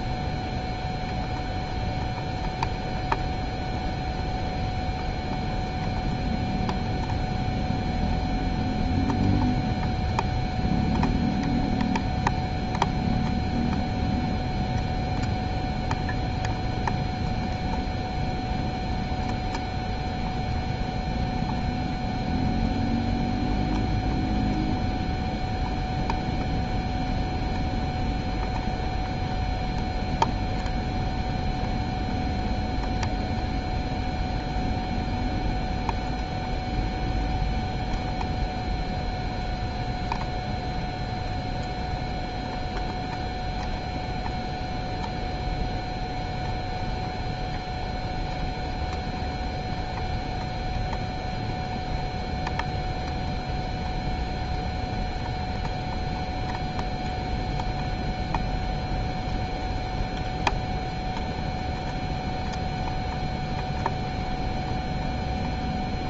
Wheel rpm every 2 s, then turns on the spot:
0, 0, 0, 0, 0, 0, 0, 0, 0, 0, 0, 0, 0, 0, 0, 0, 0, 0, 0, 0, 0, 0, 0, 0, 0, 0, 0, 0, 0, 0, 0, 0, 0.
none